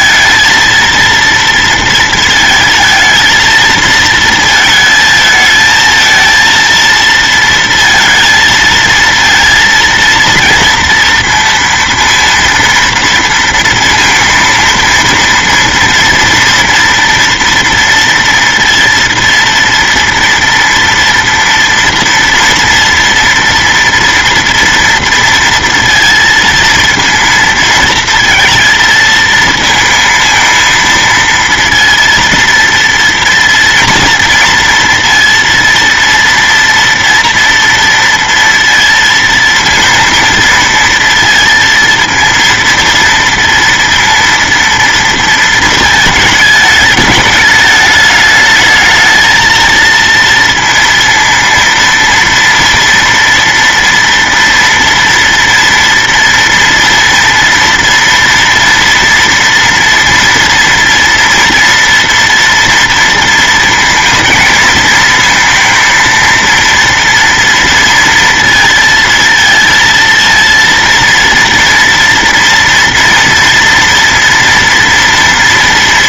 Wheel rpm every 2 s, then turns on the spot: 230, 230, 220, 230, 230, 230, 230, 230, 230, 230, 230, 230, 230, 230, 230, 220, 230, 230, 230, 230, 230, 230, 230, 220, 210, 230, 230, 230, 230, 230, 230, 230, 220, 230, 230, 230, 230, 230.
none